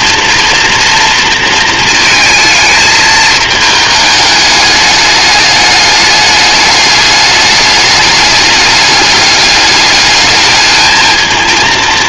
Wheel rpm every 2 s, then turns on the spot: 230, 220, 210, 210, 210, 220.
none